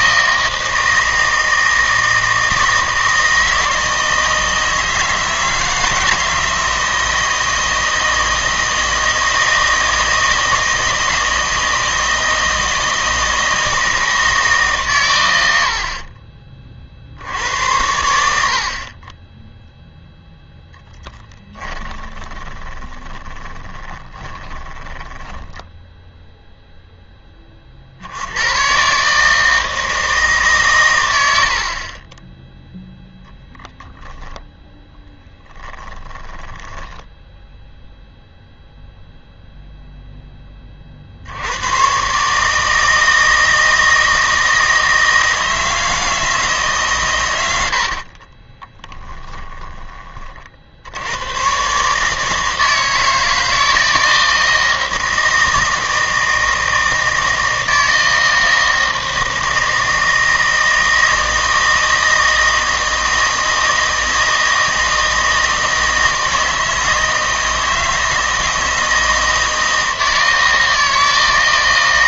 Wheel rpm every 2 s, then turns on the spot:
160, 160, 160, 160, 160, 160, 160, 140, 40, 50, 10, 20, 20, 0, 110, 130, 0, 0, 10, 0, 30, 160, 160, 150, 20, 60, 160, 160, 160, 160, 160, 160, 160, 160, 160, 160.
20-26 36-38 48-50